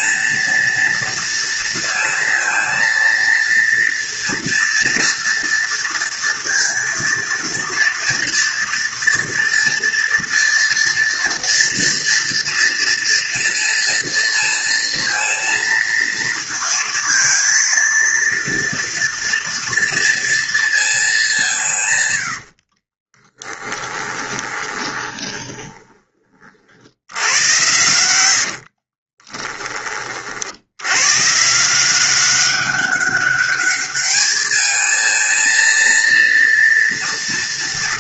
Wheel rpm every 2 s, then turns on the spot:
230, 230, 230, 230, 230, 230, 230, 230, 230, 230, 220, 50, 20, 70, 40, 100, 200, 220, 230.
22-26 28-30